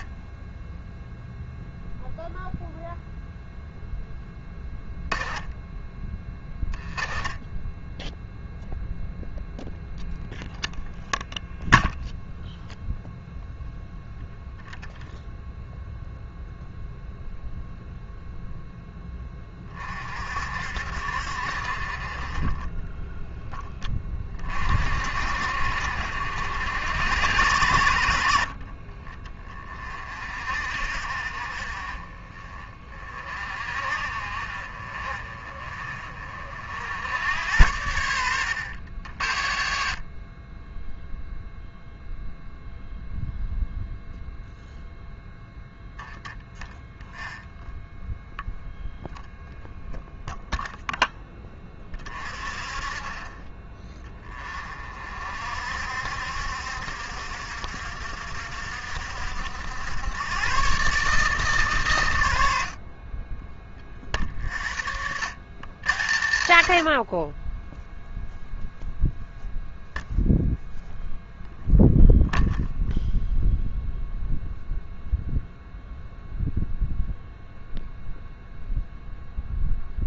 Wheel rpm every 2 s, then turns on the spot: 20, 0, 20, 10, 0, 0, 0, 0, 0, 10, 60, 20, 40, 60, 40, 50, 30, 40, 60, 90, 10, 0, 0, 0, 0, 0, 30, 30, 60, 60, 130, 70, 60, 80, 0, 0, 0, 0, 0, 0.
4-8